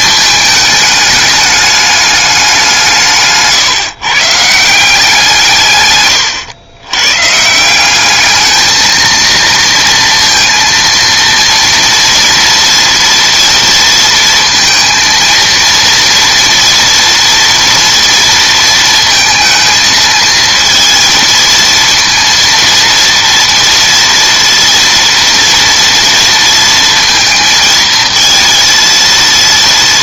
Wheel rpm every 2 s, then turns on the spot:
210, 180, 160, 110, 220, 230, 230, 230, 230, 230, 230, 230, 230, 230, 230.
none